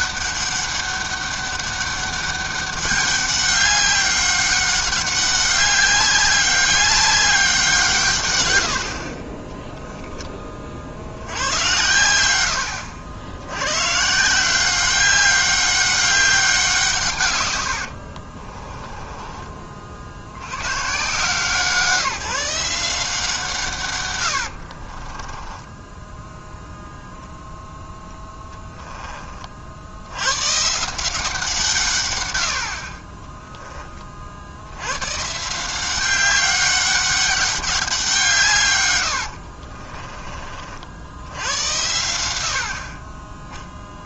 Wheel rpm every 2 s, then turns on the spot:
200, 200, 200, 200, 80, 50, 90, 190, 180, 30, 120, 170, 50, 0, 10, 160, 60, 100, 200, 110, 60, 60.
8-10 18-20 24-26